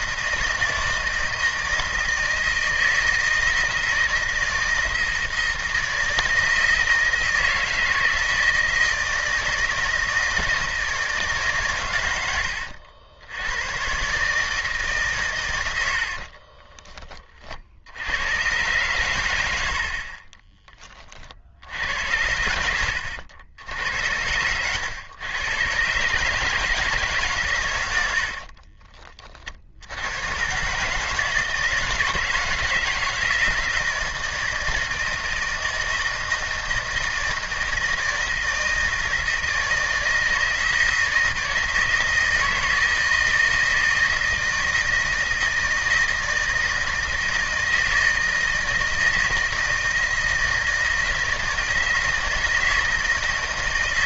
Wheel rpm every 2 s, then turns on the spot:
160, 160, 160, 160, 160, 160, 90, 150, 30, 110, 30, 80, 110, 150, 40, 130, 160, 160, 160, 160, 160, 160, 160, 160, 160, 160, 160.
16-18 22-24 28-30